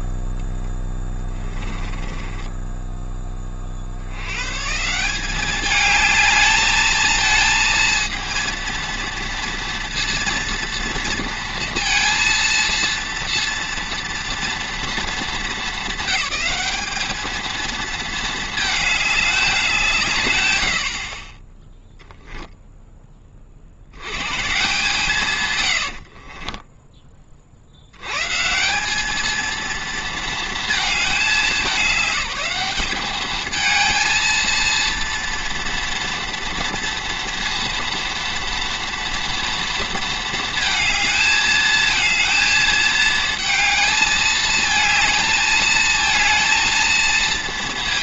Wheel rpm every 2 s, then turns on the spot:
10, 20, 140, 220, 230, 230, 230, 220, 210, 210, 70, 10, 150, 20, 190, 220, 210, 230, 230, 230, 220, 220, 220, 230.
0-4 26-28